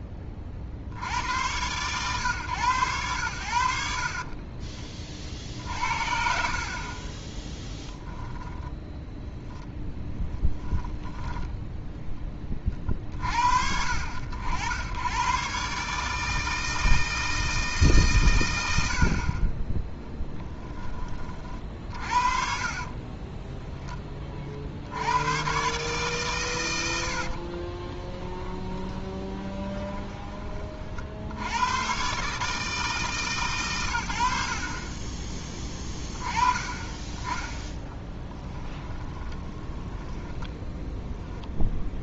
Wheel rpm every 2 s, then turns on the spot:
40, 110, 30, 40, 10, 10, 30, 80, 160, 90, 10, 40, 60, 110, 20, 40, 150, 40, 20, 10, 10.
4-6 8-12 22-24 28-30 38-40